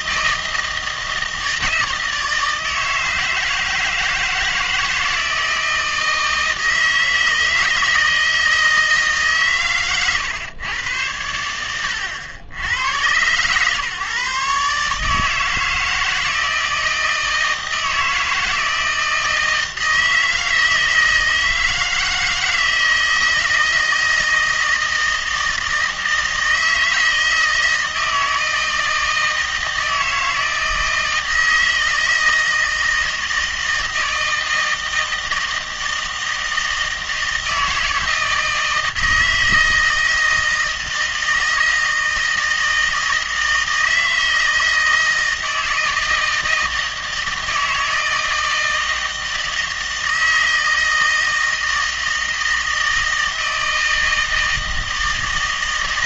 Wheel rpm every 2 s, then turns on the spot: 160, 160, 160, 160, 160, 110, 90, 140, 160, 160, 160, 160, 160, 160, 160, 160, 160, 160, 160, 160, 160, 160, 160, 160, 160, 160, 160, 160.
none